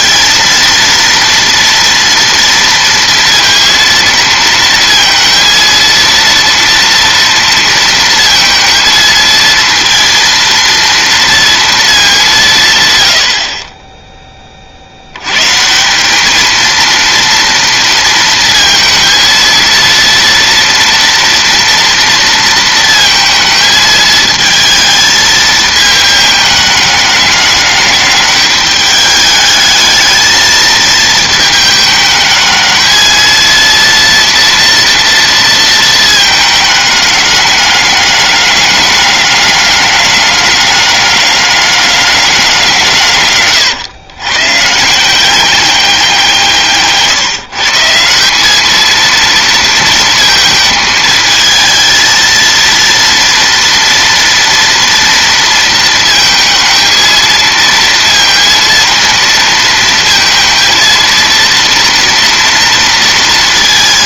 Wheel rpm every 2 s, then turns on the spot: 230, 230, 230, 230, 220, 230, 100, 60, 230, 230, 230, 230, 220, 210, 210, 220, 220, 230, 210, 200, 200, 150, 160, 140, 220, 220, 230, 230, 220, 230, 230, 230.
none